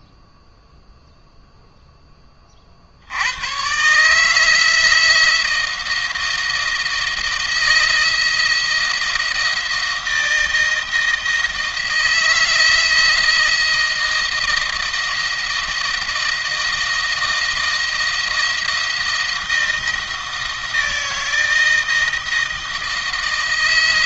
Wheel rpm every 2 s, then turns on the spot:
0, 50, 160, 160, 170, 170, 170, 160, 160, 170, 160, 160.
none